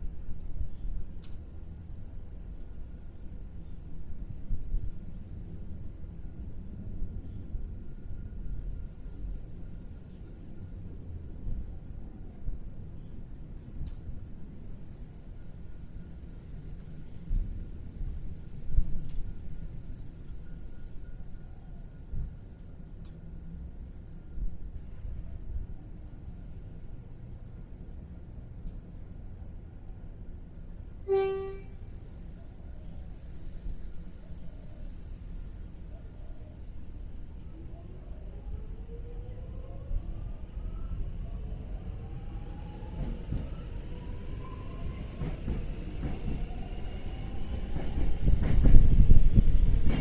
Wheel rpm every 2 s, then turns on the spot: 0, 0, 0, 0, 0, 0, 0, 0, 0, 0, 0, 0, 0, 0, 0, 0, 0, 0, 0, 0, 0, 0, 0, 0, 0.
none